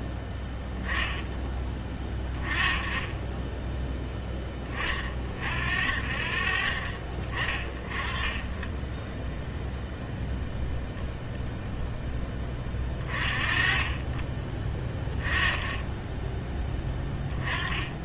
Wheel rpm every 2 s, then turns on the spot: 10, 20, 30, 60, 20, 0, 20, 20, 30.
none